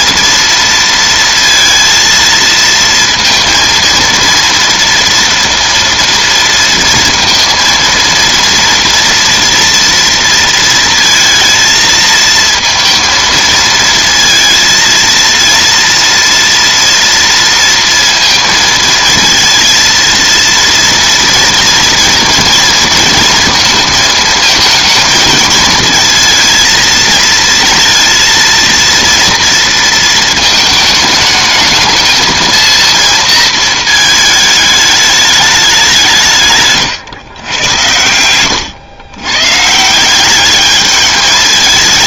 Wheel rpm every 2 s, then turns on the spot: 230, 230, 230, 230, 240, 230, 230, 230, 230, 230, 230, 230, 230, 230, 230, 220, 230, 210, 120, 120, 210.
none